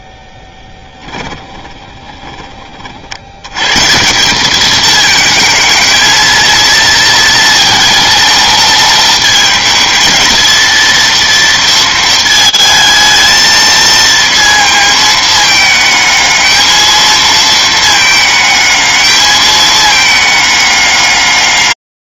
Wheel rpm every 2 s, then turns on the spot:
0, 30, 210, 230, 230, 230, 220, 230, 220, 220, 210.
none